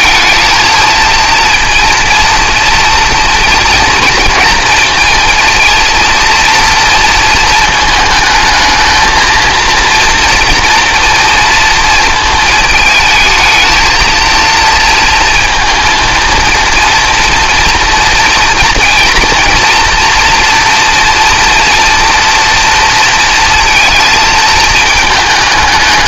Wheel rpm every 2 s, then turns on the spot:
230, 230, 230, 230, 220, 230, 220, 230, 230, 230, 240, 230, 220.
none